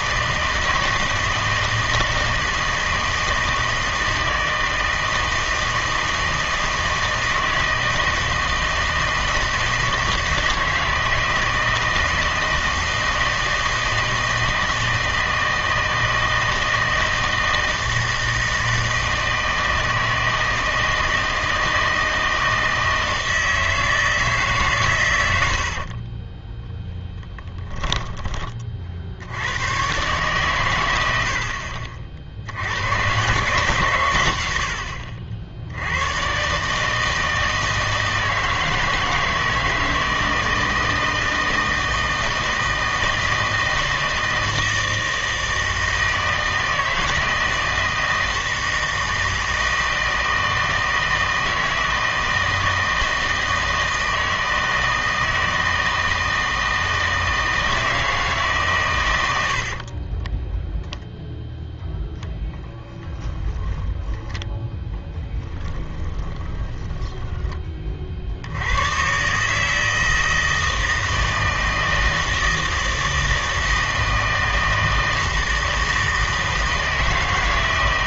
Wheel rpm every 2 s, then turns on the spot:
160, 160, 160, 160, 160, 160, 160, 160, 160, 160, 160, 160, 140, 10, 30, 120, 80, 80, 150, 160, 160, 160, 160, 160, 160, 160, 160, 160, 160, 130, 0, 10, 10, 20, 90, 160, 160, 160, 160.
26-28 62-64 66-68